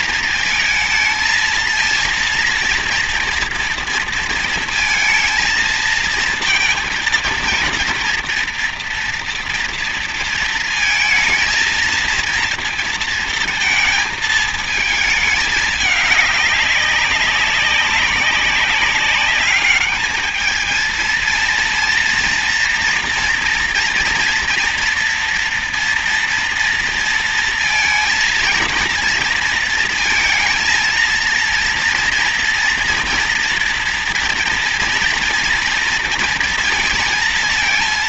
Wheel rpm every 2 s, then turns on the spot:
230, 230, 230, 230, 240, 230, 230, 220, 200, 190, 220, 240, 240, 230, 230, 230, 230, 230, 230.
none